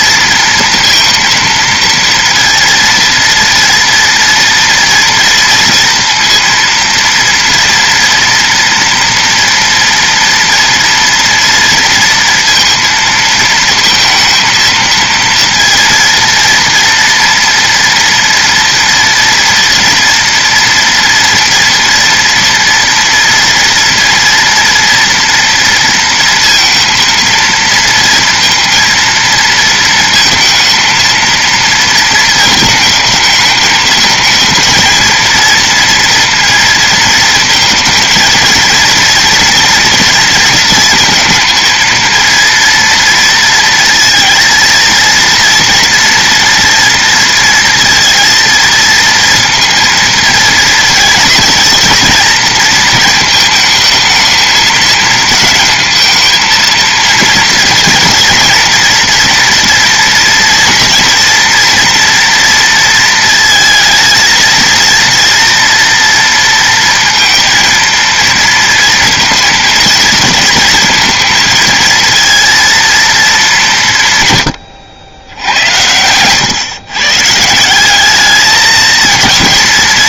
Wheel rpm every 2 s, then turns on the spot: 230, 230, 230, 230, 230, 230, 230, 220, 230, 230, 230, 240, 230, 230, 230, 230, 220, 220, 230, 230, 230, 230, 230, 230, 230, 230, 230, 220, 220, 230, 230, 230, 230, 230, 230, 230, 230, 120, 130, 220.
none